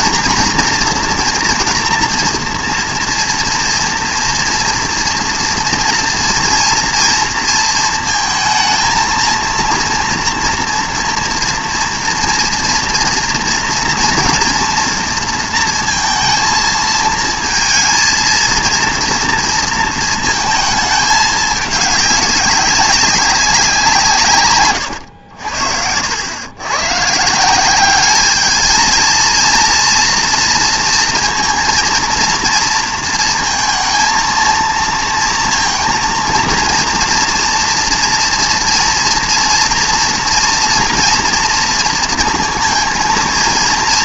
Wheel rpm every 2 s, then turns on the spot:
230, 230, 230, 230, 220, 230, 230, 230, 220, 230, 220, 190, 110, 120, 220, 230, 230, 230, 230, 240, 240, 230.
none